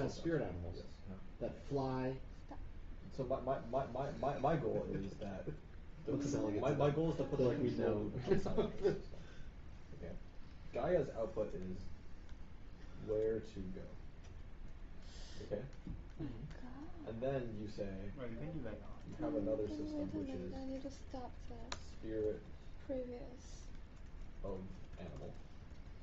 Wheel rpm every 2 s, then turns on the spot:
0, 0, 0, 0, 0, 0, 0, 0, 0, 0, 0, 0, 0.
none